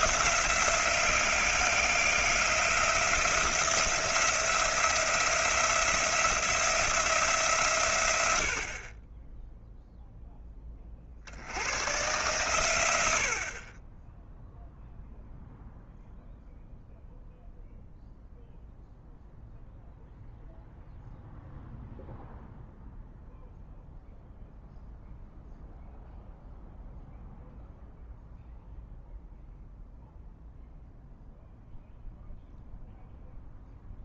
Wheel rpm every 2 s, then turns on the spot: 170, 170, 170, 170, 50, 30, 100, 0, 0, 0, 0, 0, 0, 0, 0, 0, 0.
none